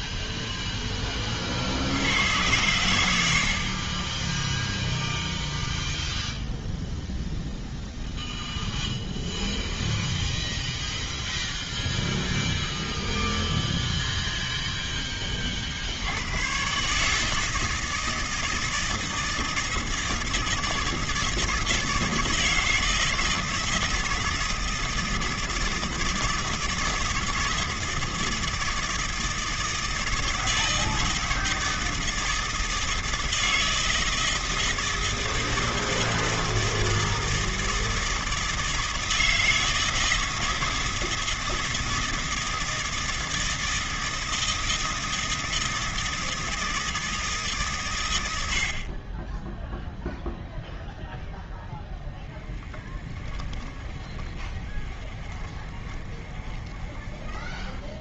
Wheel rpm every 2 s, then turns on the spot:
0, 90, 10, 0, 0, 0, 0, 10, 140, 160, 160, 160, 170, 160, 160, 160, 160, 160, 160, 160, 160, 160, 160, 110, 0, 0, 20, 30, 40.
52-56